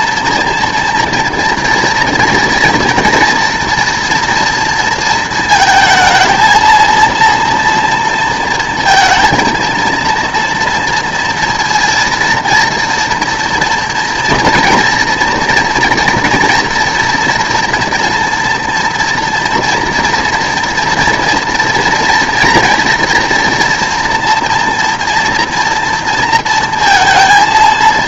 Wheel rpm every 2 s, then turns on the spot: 230, 230, 230, 230, 230, 230, 230, 240, 230, 230, 240, 230, 230, 230.
none